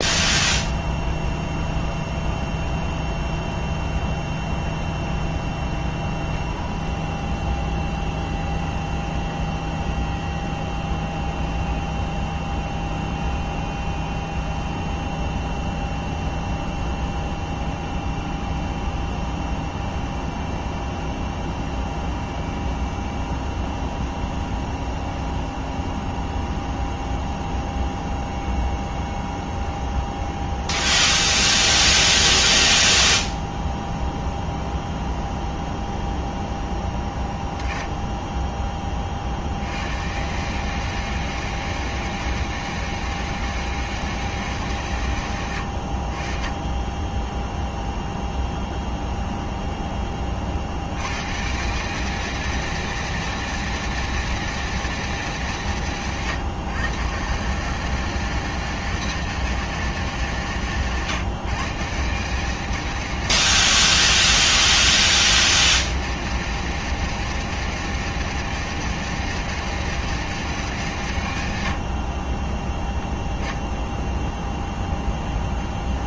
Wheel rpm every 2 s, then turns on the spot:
0, 0, 0, 0, 0, 0, 0, 0, 0, 0, 0, 0, 0, 0, 0, 0, 0, 0, 10, 20, 140, 160, 140, 30, 0, 70, 230, 230, 150, 210, 170, 200, 210, 210, 210, 190, 20, 20.
72-76